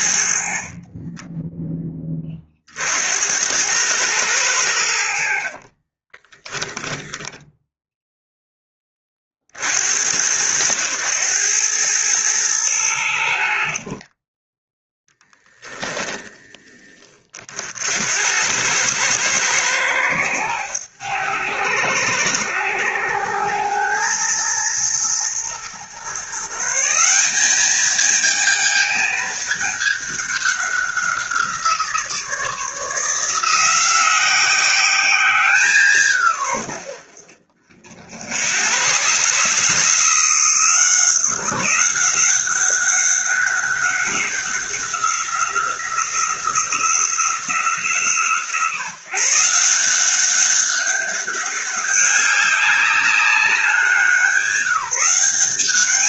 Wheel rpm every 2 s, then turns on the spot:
40, 50, 90, 20, 10, 100, 100, 10, 30, 100, 100, 90, 110, 160, 220, 190, 160, 190, 80, 110, 170, 200, 190, 180, 150, 200, 200, 180.
0-2 6-8 14-16